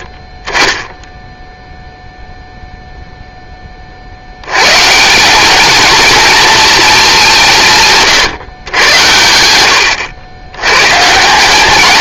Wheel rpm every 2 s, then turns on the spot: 20, 0, 130, 220, 110, 120.
none